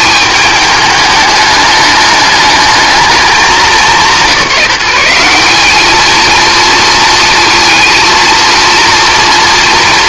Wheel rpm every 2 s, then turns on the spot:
210, 220, 180, 230, 230.
none